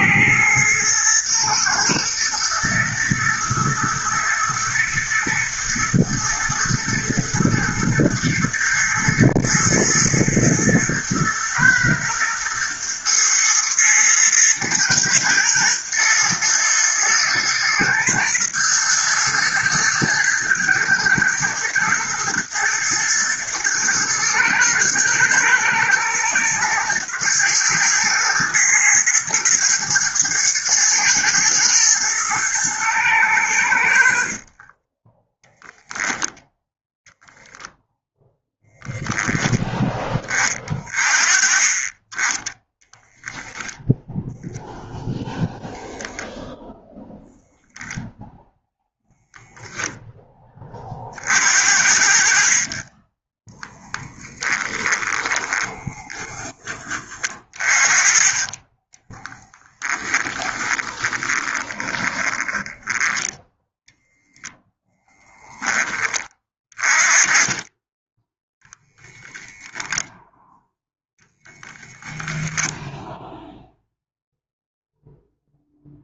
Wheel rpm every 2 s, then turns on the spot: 110, 110, 110, 110, 120, 120, 120, 110, 110, 120, 110, 110, 110, 120, 110, 110, 110, 10, 0, 0, 30, 10, 0, 0, 0, 30, 30, 10, 20, 20, 20, 10, 0, 20, 0, 0, 0, 0.
34-36 54-56 58-64